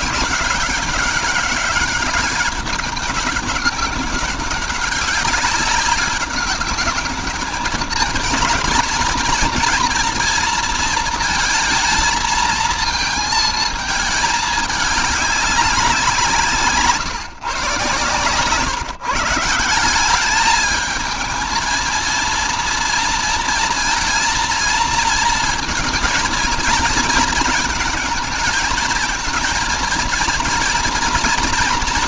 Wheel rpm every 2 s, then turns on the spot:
190, 200, 190, 200, 220, 220, 230, 210, 150, 130, 210, 230, 230, 230, 230, 240.
none